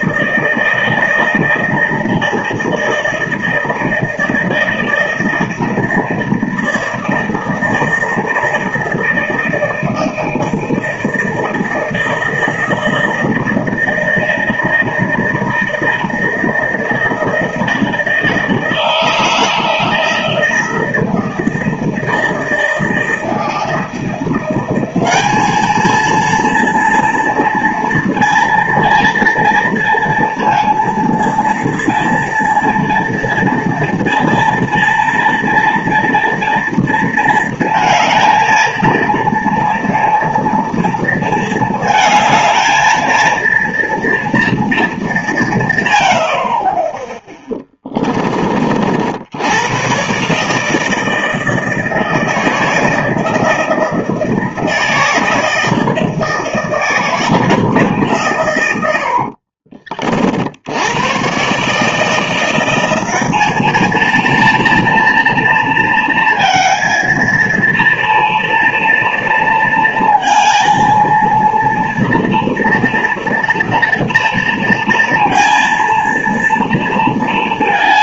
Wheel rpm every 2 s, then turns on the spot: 160, 160, 160, 160, 160, 160, 160, 160, 160, 160, 160, 160, 190, 230, 230, 230, 230, 230, 230, 220, 230, 220, 220, 30, 50, 160, 160, 160, 160, 80, 90, 180, 230, 230, 230, 230, 240, 230, 230.
none